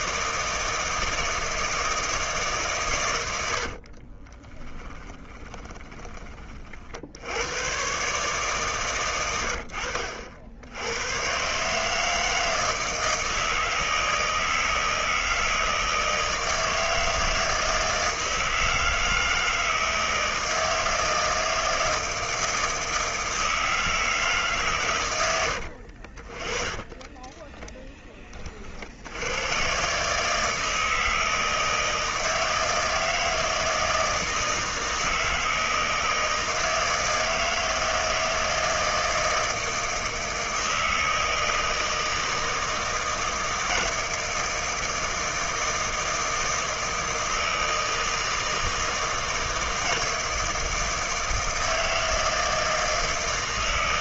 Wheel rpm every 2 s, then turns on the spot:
160, 140, 20, 40, 130, 80, 160, 160, 160, 160, 160, 160, 140, 40, 40, 160, 160, 160, 160, 160, 160, 160, 160, 160, 160, 160, 160.
4-6 26-28